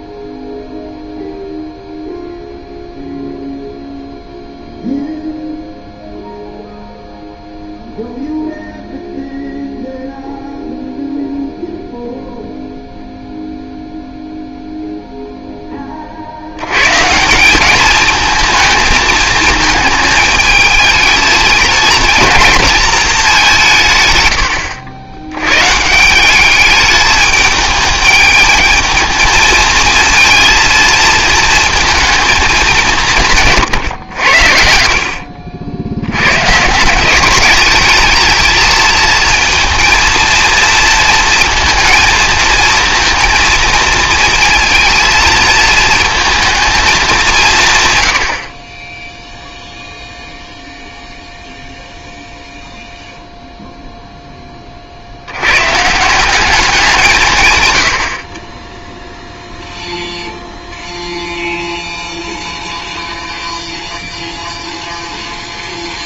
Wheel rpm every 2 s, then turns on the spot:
0, 0, 0, 0, 0, 0, 0, 0, 100, 220, 220, 220, 90, 200, 220, 230, 200, 70, 150, 220, 230, 230, 230, 220, 40, 0, 0, 30, 180, 10, 0, 0, 0.
none